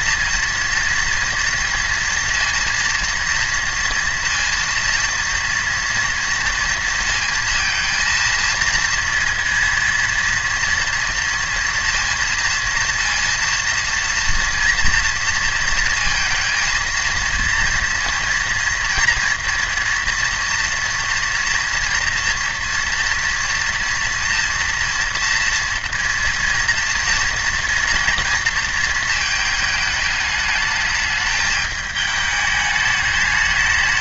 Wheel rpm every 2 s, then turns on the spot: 230, 230, 230, 230, 230, 230, 230, 230, 230, 230, 230, 230, 230, 230, 230, 210, 210.
none